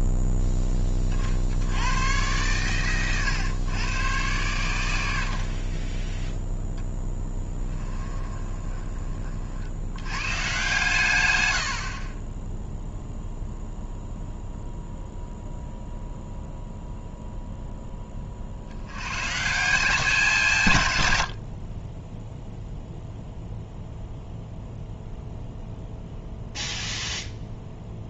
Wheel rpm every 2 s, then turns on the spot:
20, 120, 90, 0, 30, 130, 0, 0, 0, 100, 120, 0, 0, 0.
none